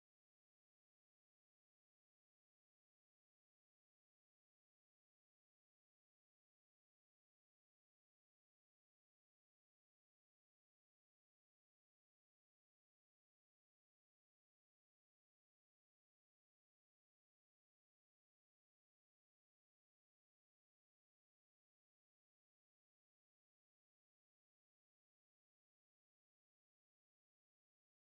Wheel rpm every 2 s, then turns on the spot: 0, 0, 0, 0, 0, 0, 0, 0, 0, 0, 0, 0, 0, 0.
none